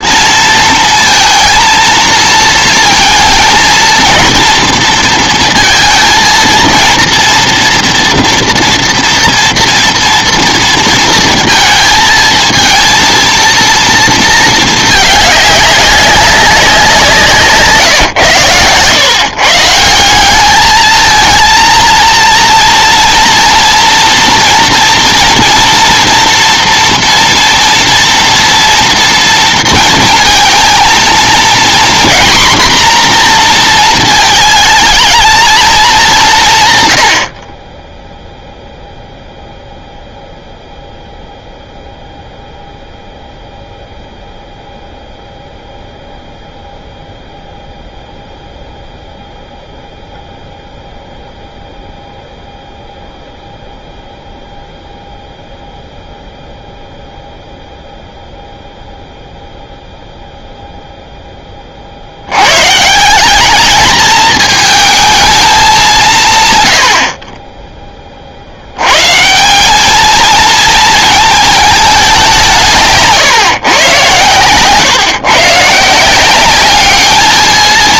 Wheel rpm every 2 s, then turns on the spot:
230, 220, 230, 230, 230, 230, 220, 220, 180, 120, 210, 230, 230, 230, 230, 230, 240, 220, 130, 0, 0, 0, 0, 0, 0, 0, 0, 0, 0, 0, 0, 130, 220, 100, 90, 220, 160, 130, 210.
none